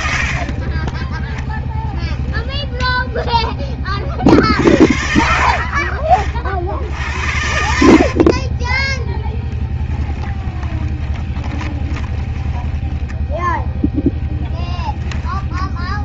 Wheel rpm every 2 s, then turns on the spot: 30, 0, 60, 60, 10, 10, 20, 0.
0-2 6-14